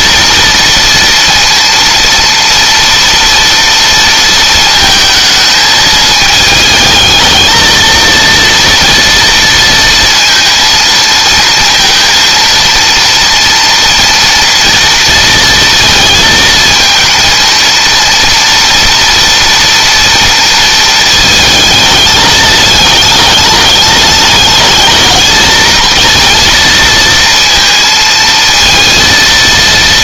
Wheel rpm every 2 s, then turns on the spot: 230, 230, 220, 220, 230, 230, 230, 230, 220, 230, 220, 210, 210, 230, 230.
none